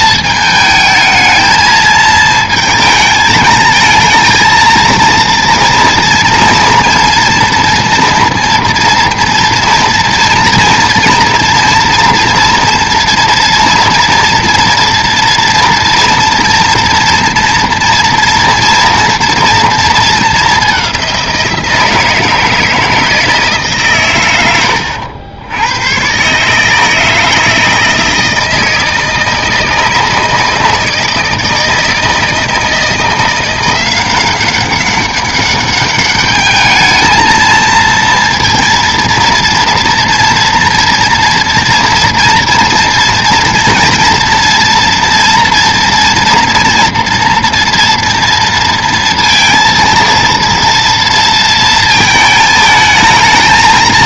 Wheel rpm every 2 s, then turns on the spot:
220, 220, 230, 230, 230, 230, 230, 230, 230, 230, 210, 160, 100, 130, 160, 160, 160, 190, 210, 230, 230, 230, 230, 240, 230, 230, 220.
none